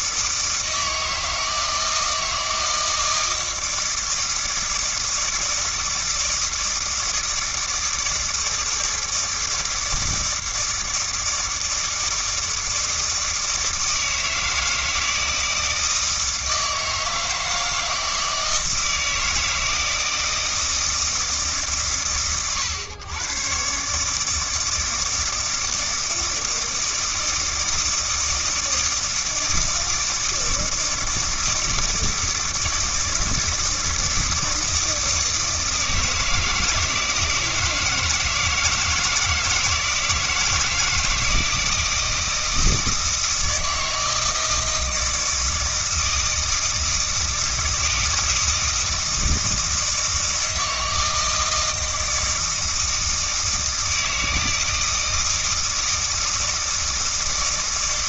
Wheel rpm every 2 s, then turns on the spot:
160, 160, 160, 160, 160, 160, 160, 160, 160, 160, 160, 100, 160, 160, 160, 160, 160, 160, 160, 170, 160, 160, 160, 160, 160, 160, 160, 160, 160.
none